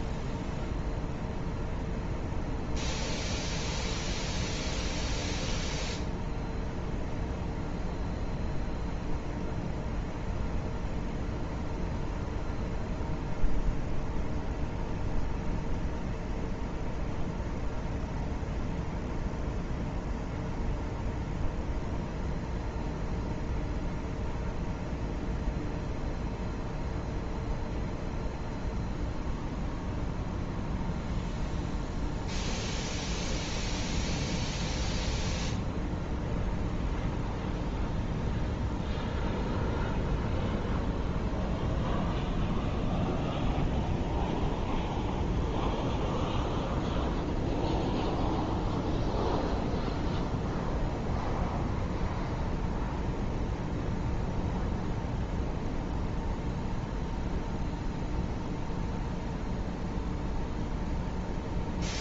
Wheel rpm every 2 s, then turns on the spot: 0, 0, 0, 0, 0, 0, 0, 0, 0, 0, 0, 0, 0, 0, 0, 0, 0, 0, 0, 0, 0, 0, 0, 0, 0, 0, 0, 0, 0, 0, 0.
none